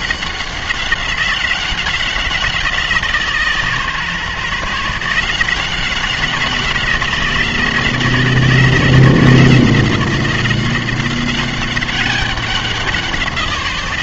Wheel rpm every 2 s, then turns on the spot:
190, 170, 150, 180, 170, 180, 190.
none